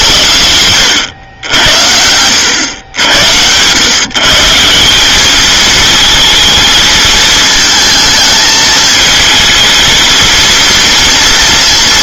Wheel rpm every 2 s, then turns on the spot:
90, 100, 170, 220, 220, 230.
none